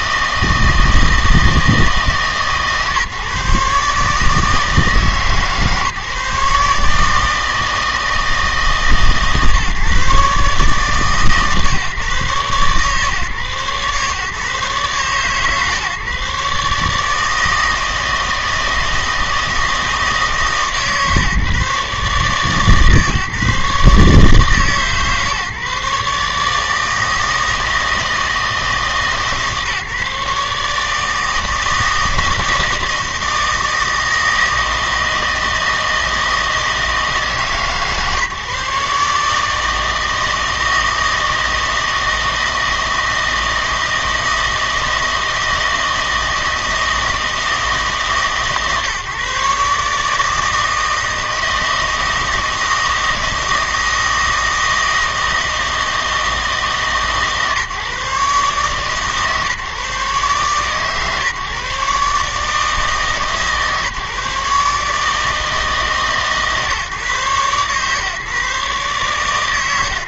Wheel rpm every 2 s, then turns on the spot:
160, 140, 160, 150, 160, 150, 130, 140, 140, 160, 150, 140, 140, 160, 160, 150, 160, 160, 160, 150, 160, 160, 160, 160, 150, 160, 160, 160, 160, 140, 130, 150, 140, 140, 130.
none